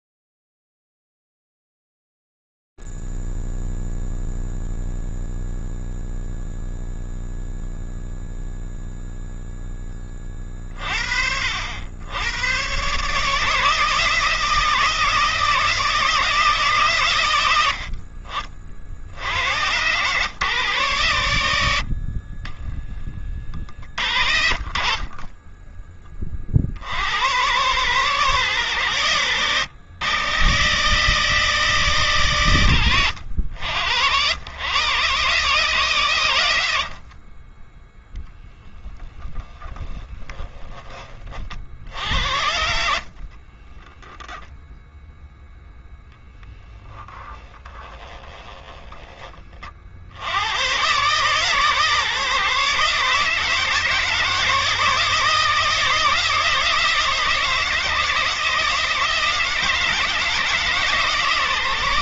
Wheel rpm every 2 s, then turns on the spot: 0, 0, 0, 0, 0, 30, 110, 160, 150, 50, 120, 30, 40, 60, 110, 140, 100, 130, 70, 20, 30, 50, 0, 10, 50, 140, 150, 160, 160, 160, 150.
22-24 38-40 42-44